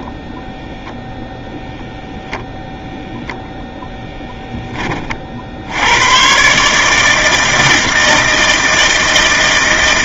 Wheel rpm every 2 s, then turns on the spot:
0, 0, 20, 130, 160.
4-6